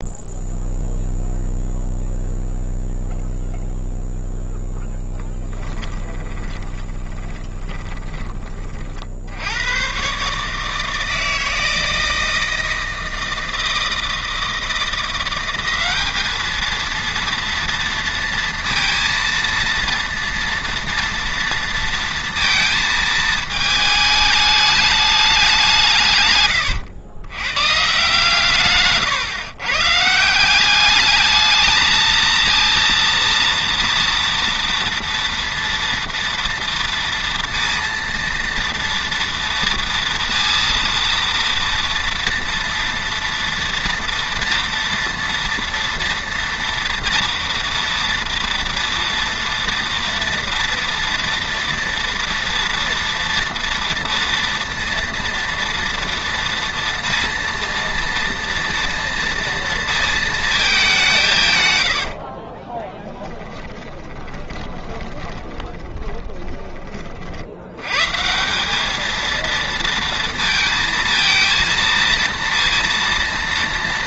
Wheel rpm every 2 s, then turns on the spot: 0, 0, 10, 30, 70, 160, 160, 180, 230, 230, 230, 220, 200, 110, 140, 210, 230, 230, 230, 240, 230, 230, 230, 230, 230, 230, 230, 230, 230, 230, 160, 20, 20, 50, 220, 230, 230.
4-8 62-66